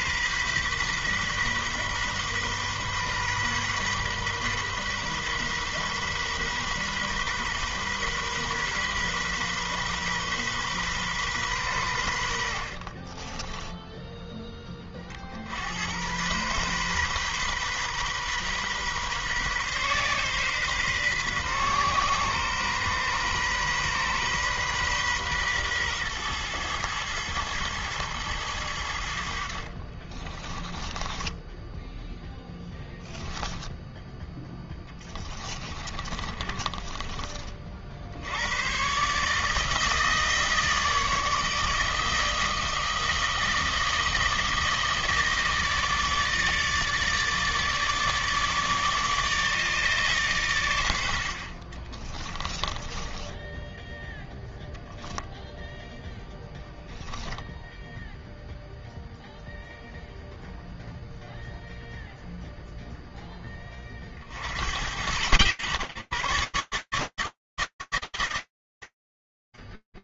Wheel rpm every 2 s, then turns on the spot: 130, 130, 130, 130, 130, 130, 60, 10, 120, 130, 130, 130, 130, 120, 100, 20, 10, 10, 30, 100, 160, 160, 160, 150, 150, 120, 20, 0, 0, 0, 0, 0, 90, 140, 50.
30-34 36-38 52-54